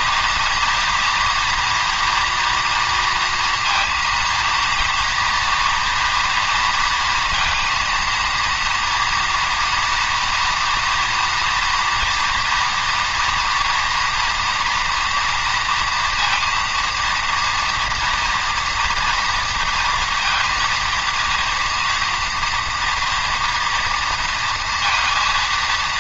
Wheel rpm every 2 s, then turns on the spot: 230, 240, 230, 230, 230, 230, 230, 230, 230, 230, 230, 230, 230.
none